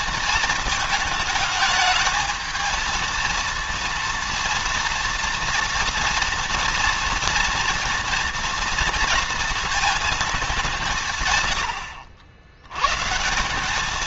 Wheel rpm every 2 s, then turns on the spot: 220, 220, 230, 230, 230, 150, 140.
none